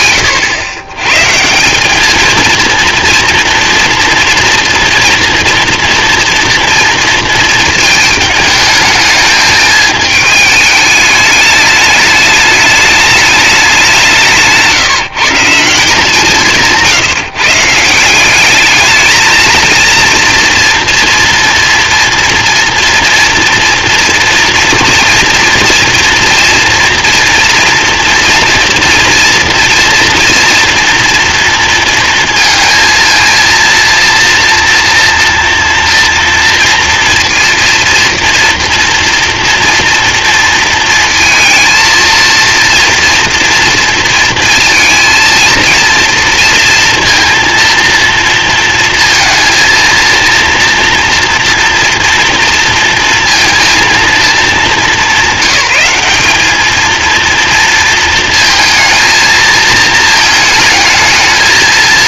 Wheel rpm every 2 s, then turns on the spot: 110, 230, 240, 230, 220, 210, 210, 150, 160, 220, 230, 240, 240, 240, 230, 230, 230, 230, 230, 240, 230, 230, 230, 230, 230, 240, 230, 190, 230, 220, 220.
none